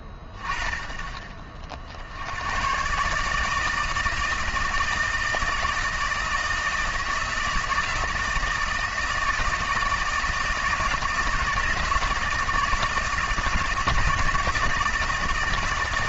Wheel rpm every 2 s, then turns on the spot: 20, 110, 160, 160, 160, 160, 160, 160.
none